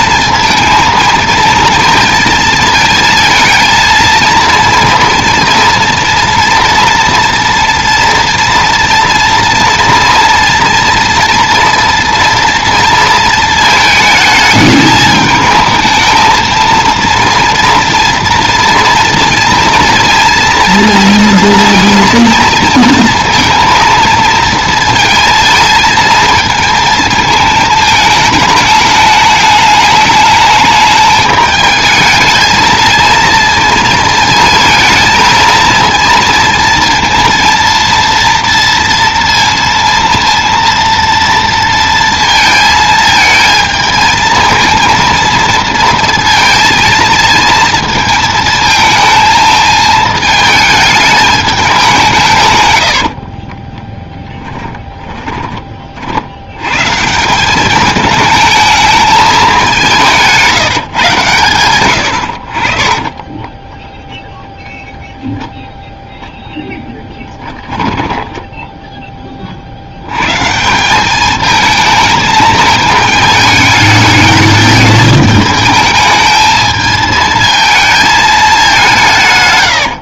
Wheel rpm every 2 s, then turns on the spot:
230, 220, 230, 230, 230, 240, 230, 220, 230, 230, 230, 230, 230, 220, 210, 210, 220, 220, 230, 230, 230, 220, 230, 230, 220, 210, 90, 20, 140, 210, 150, 40, 0, 10, 10, 180, 220, 210, 220, 180.
52-56